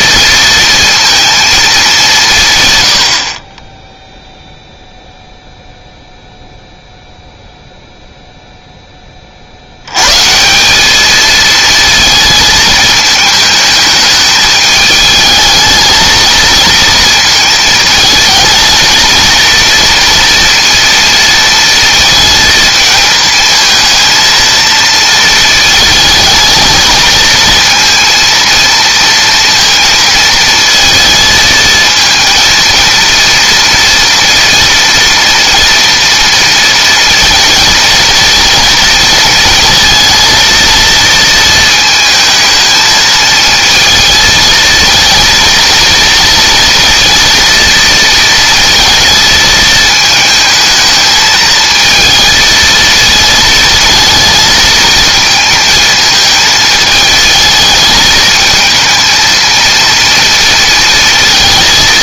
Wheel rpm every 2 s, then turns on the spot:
230, 110, 0, 0, 20, 200, 220, 210, 220, 220, 230, 220, 230, 220, 230, 220, 230, 230, 230, 230, 230, 220, 230, 230, 220, 220, 220, 220, 220, 220, 230.
none